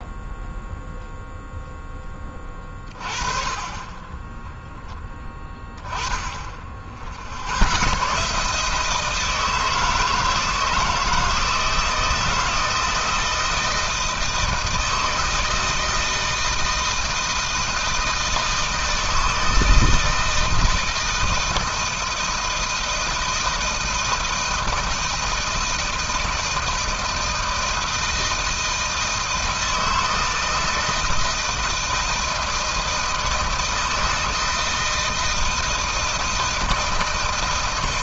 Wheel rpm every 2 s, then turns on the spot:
0, 30, 20, 20, 130, 160, 170, 160, 160, 160, 160, 160, 160, 160, 160, 160, 160, 160, 160.
4-6